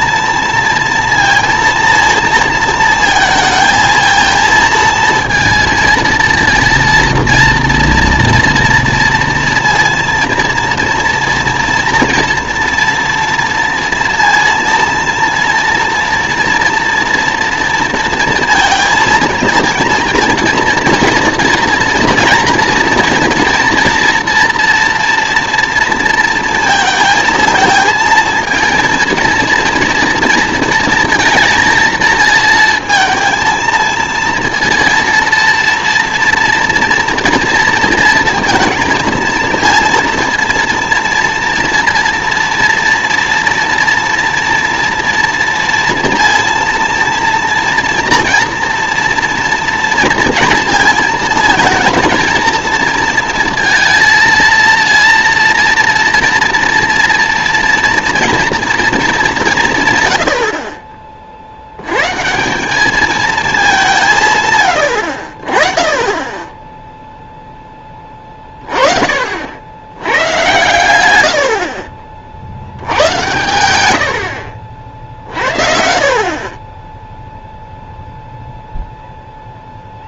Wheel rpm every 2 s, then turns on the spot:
230, 230, 230, 230, 230, 230, 230, 230, 230, 230, 230, 230, 230, 230, 220, 230, 230, 230, 240, 230, 230, 240, 230, 230, 230, 230, 230, 230, 240, 230, 50, 190, 120, 10, 30, 110, 80, 60, 20, 0.
none